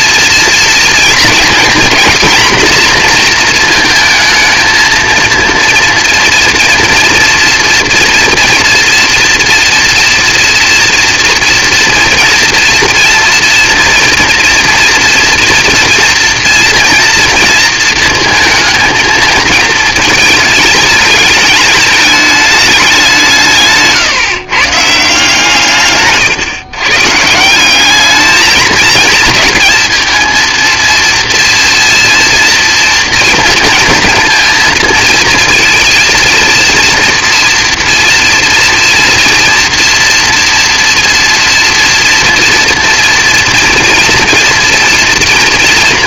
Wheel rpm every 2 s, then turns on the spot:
240, 230, 230, 230, 230, 240, 230, 240, 230, 220, 210, 160, 170, 170, 220, 230, 230, 230, 230, 240, 230, 240, 230.
none